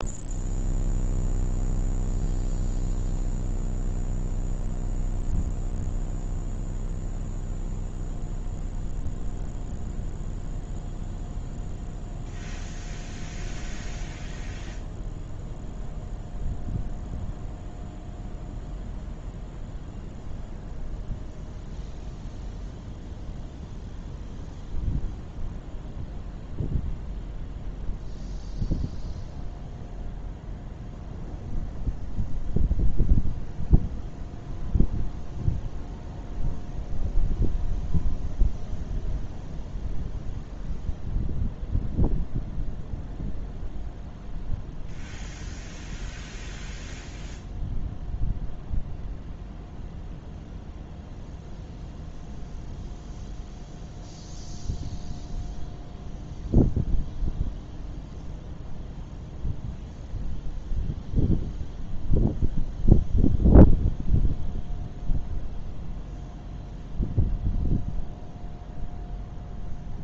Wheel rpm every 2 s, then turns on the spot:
0, 0, 0, 0, 0, 0, 0, 0, 0, 0, 0, 0, 0, 0, 0, 0, 0, 0, 0, 0, 0, 0, 0, 0, 0, 0, 0, 0, 0, 0, 0, 0, 0, 0, 0.
none